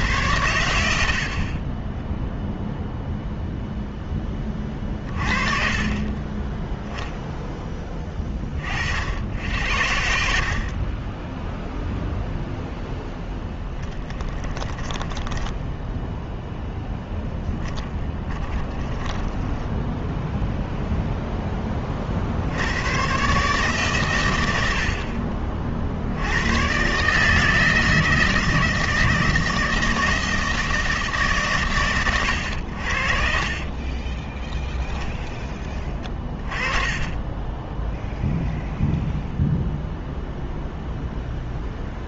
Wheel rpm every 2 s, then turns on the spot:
90, 0, 20, 10, 40, 50, 0, 20, 0, 10, 0, 80, 90, 110, 160, 160, 80, 10, 20, 0, 0.
14-16 18-20 36-38